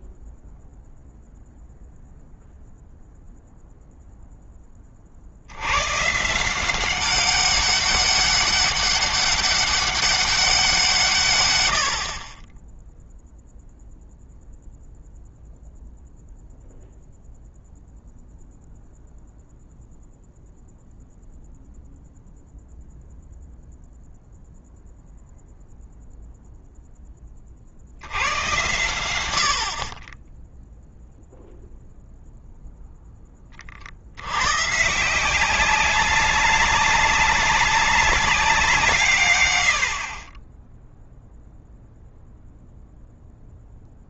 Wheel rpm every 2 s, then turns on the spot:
0, 0, 100, 200, 200, 90, 0, 0, 0, 0, 0, 0, 0, 60, 60, 0, 20, 180, 190, 120, 0, 0.
none